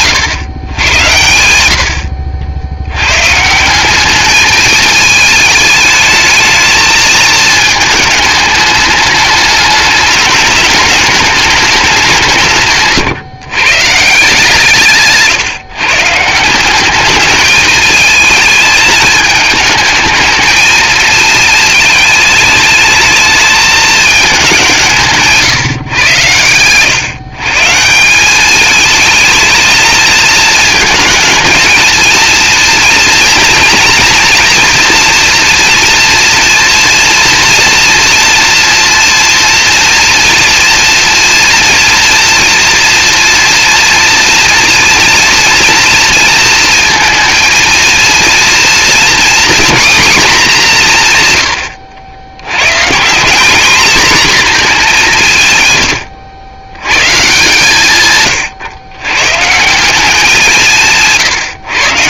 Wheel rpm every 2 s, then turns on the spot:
120, 100, 220, 220, 210, 210, 140, 150, 200, 220, 220, 220, 180, 120, 220, 220, 230, 230, 230, 230, 230, 230, 230, 230, 230, 180, 120, 200, 110, 120, 160.
none